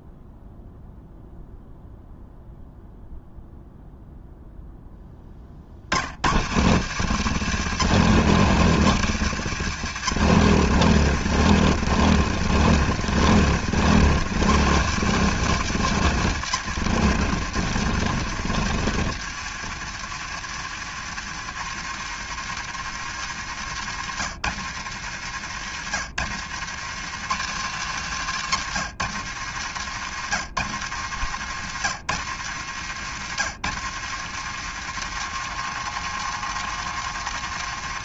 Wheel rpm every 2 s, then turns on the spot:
0, 0, 20, 170, 180, 170, 170, 190, 160, 130, 120, 120, 110, 140, 120, 100, 110, 130, 130.
none